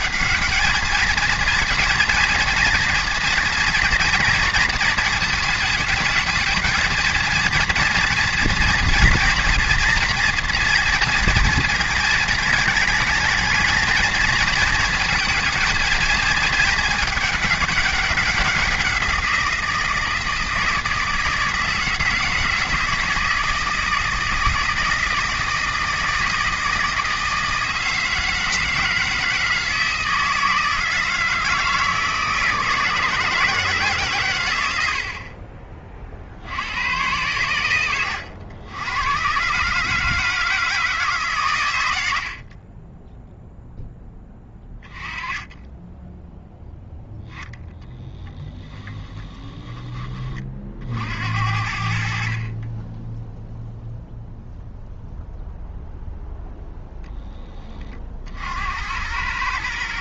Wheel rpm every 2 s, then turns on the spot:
220, 230, 220, 230, 230, 230, 220, 230, 210, 180, 160, 160, 160, 160, 160, 160, 160, 80, 100, 100, 150, 10, 20, 0, 20, 50, 10, 0, 0, 80.
48-50